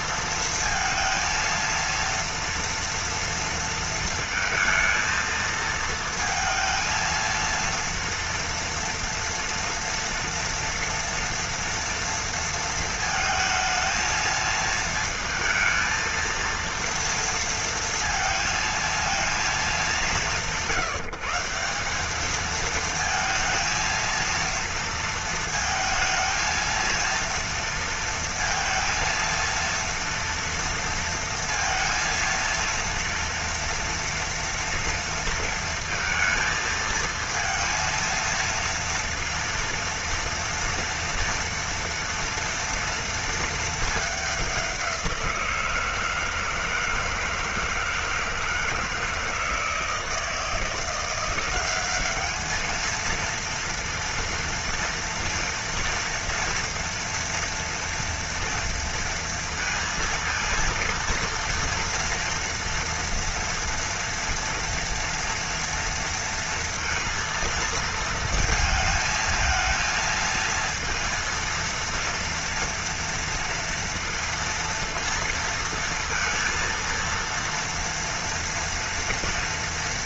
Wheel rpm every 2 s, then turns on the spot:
230, 230, 220, 230, 230, 230, 230, 220, 230, 230, 150, 220, 230, 230, 230, 230, 230, 230, 230, 230, 230, 230, 190, 160, 160, 170, 220, 230, 230, 230, 230, 230, 240, 230, 220, 230, 230, 230, 230, 230.
none